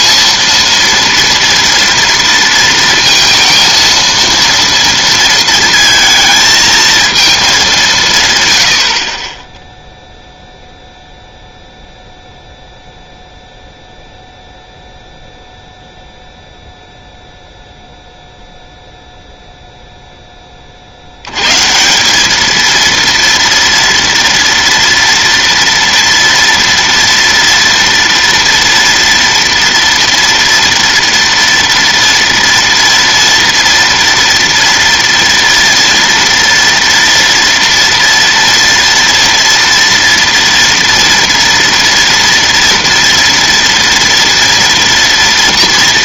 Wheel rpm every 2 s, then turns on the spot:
230, 230, 230, 220, 100, 0, 0, 0, 0, 0, 20, 220, 230, 230, 230, 240, 230, 230, 230, 230, 230, 230, 230.
none